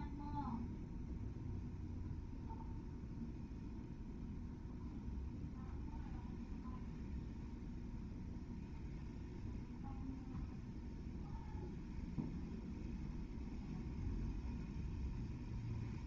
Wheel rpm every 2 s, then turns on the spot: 0, 0, 0, 0, 0, 0, 0, 0.
none